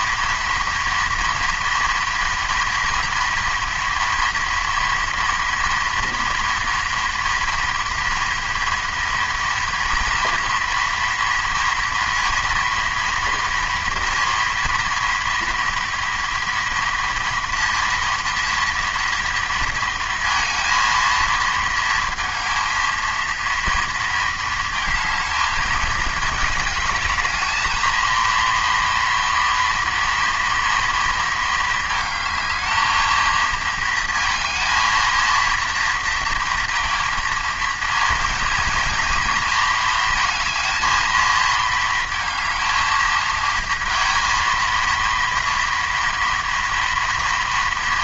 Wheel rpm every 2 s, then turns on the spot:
230, 240, 230, 230, 230, 230, 240, 230, 230, 230, 230, 230, 220, 210, 230, 230, 220, 230, 230, 230, 220, 220, 230, 230.
none